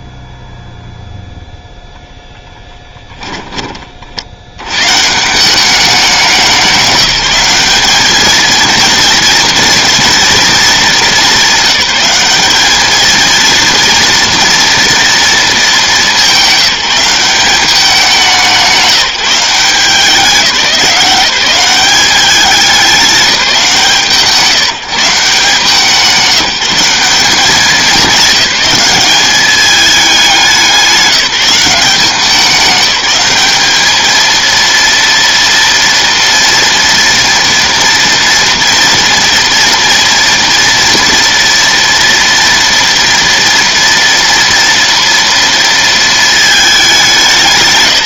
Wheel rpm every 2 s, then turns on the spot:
0, 10, 130, 190, 230, 210, 220, 230, 190, 180, 180, 200, 170, 190, 200, 180, 200, 230, 230, 230, 230, 230, 230, 200.
2-4